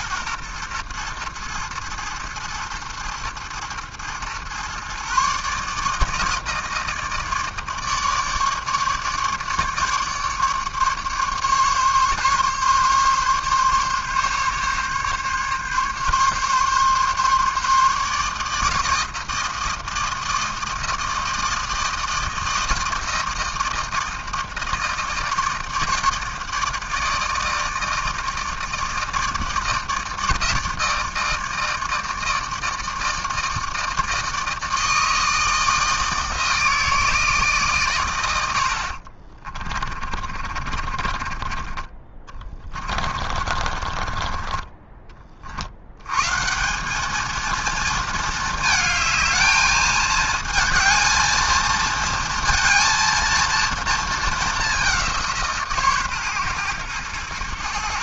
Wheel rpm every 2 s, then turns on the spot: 120, 110, 120, 160, 150, 150, 140, 140, 140, 160, 160, 160, 160, 160, 160, 160, 160, 160, 160, 90, 50, 20, 30, 170, 220, 220, 230, 210, 120.
40-46